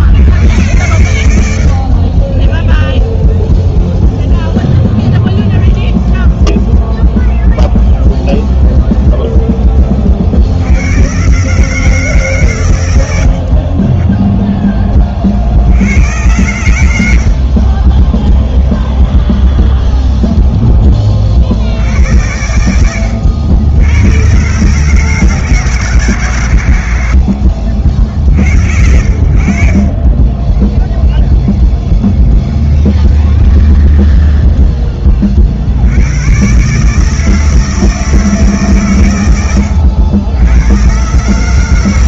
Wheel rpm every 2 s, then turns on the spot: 50, 0, 0, 0, 20, 150, 20, 80, 20, 0, 80, 90, 160, 40, 40, 10, 0, 50, 160, 90, 150.
30-32